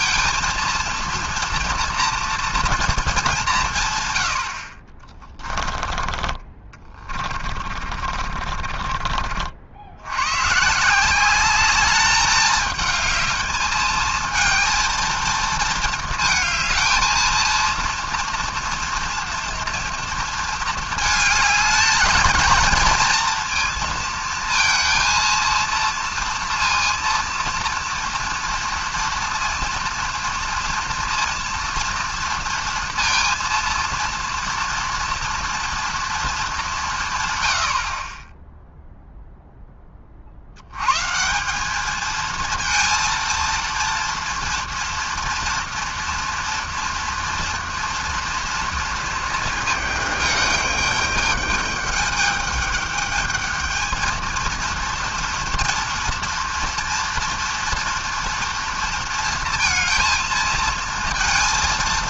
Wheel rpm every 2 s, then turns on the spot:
230, 230, 70, 30, 40, 140, 220, 220, 220, 230, 220, 220, 230, 230, 230, 230, 230, 230, 190, 0, 80, 230, 240, 230, 230, 210, 210, 230, 230, 230, 230.
6-10